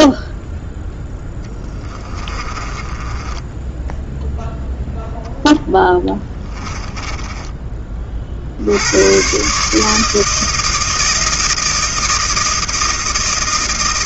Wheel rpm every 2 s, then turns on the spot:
0, 20, 0, 20, 80, 160, 160.
2-4 6-8